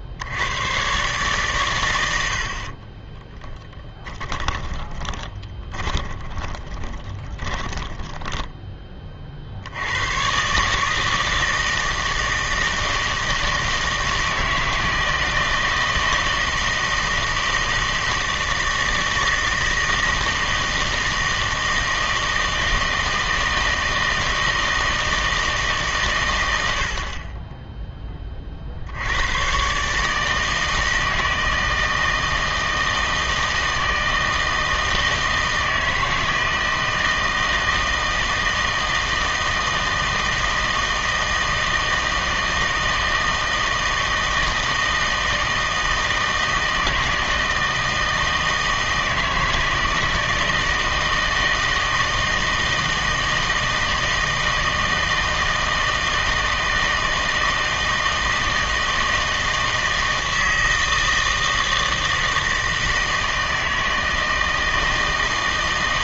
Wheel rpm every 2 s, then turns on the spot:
110, 50, 20, 20, 10, 140, 160, 160, 160, 160, 160, 160, 160, 80, 50, 160, 160, 160, 160, 160, 160, 160, 160, 160, 160, 160, 160, 160, 160, 160, 160, 160, 160.
2-8